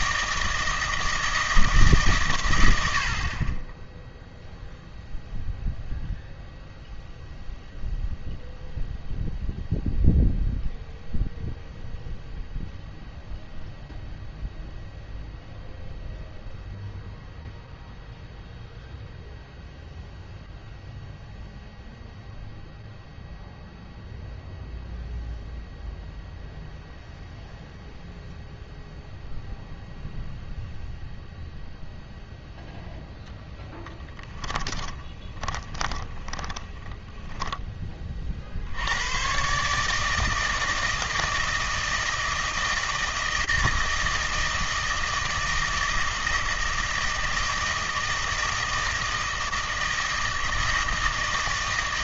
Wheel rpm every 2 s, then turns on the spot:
160, 80, 0, 0, 0, 0, 0, 0, 0, 0, 0, 0, 0, 0, 0, 0, 0, 20, 10, 80, 160, 160, 160, 160, 160, 160.
34-38